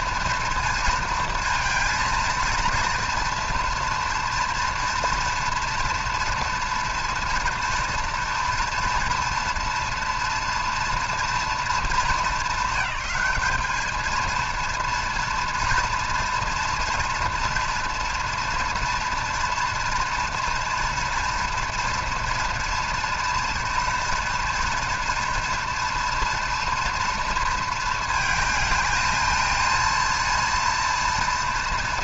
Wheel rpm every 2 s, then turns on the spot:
230, 230, 230, 230, 230, 230, 200, 230, 230, 230, 240, 240, 230, 230, 220, 230.
none